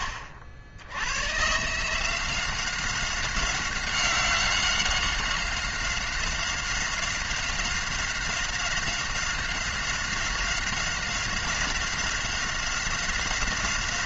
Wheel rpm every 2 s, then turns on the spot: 80, 190, 190, 190, 190, 190, 190.
none